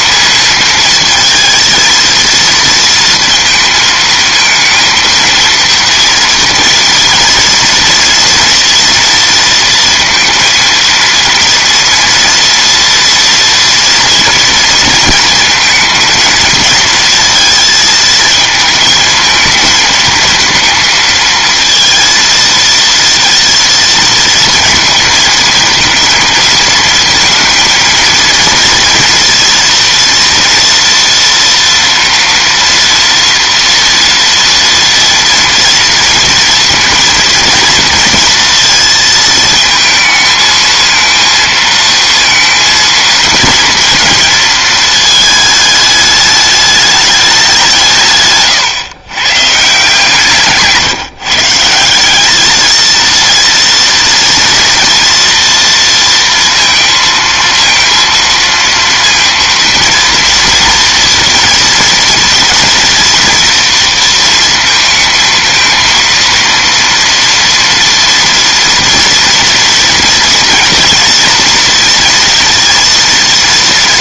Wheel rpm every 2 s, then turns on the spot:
220, 230, 220, 230, 230, 230, 230, 230, 230, 220, 220, 230, 230, 220, 230, 230, 230, 230, 230, 220, 220, 230, 220, 210, 120, 150, 230, 240, 230, 230, 230, 230, 220, 230, 230, 230, 230.
none